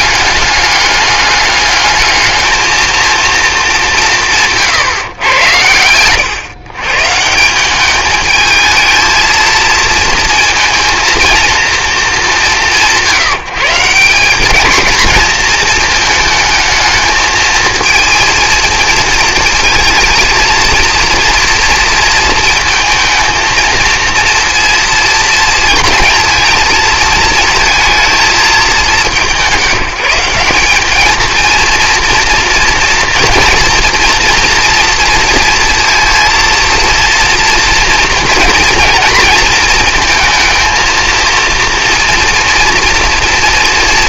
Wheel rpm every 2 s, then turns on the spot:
210, 220, 150, 130, 220, 230, 190, 200, 220, 230, 230, 220, 230, 230, 200, 190, 230, 230, 230, 230, 220, 240.
none